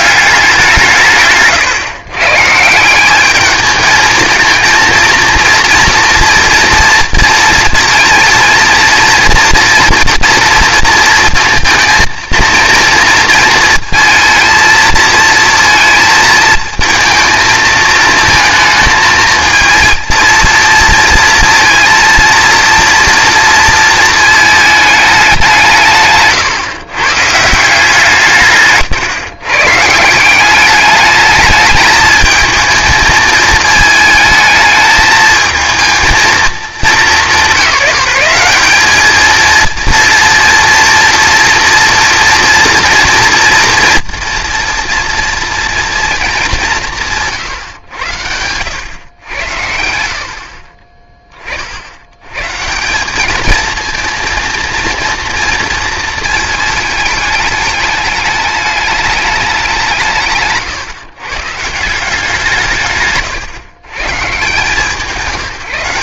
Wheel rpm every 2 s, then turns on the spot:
180, 160, 230, 240, 230, 230, 230, 230, 220, 220, 230, 230, 220, 130, 150, 200, 220, 220, 210, 200, 230, 230, 240, 190, 100, 30, 160, 230, 220, 210, 140, 160, 160.
none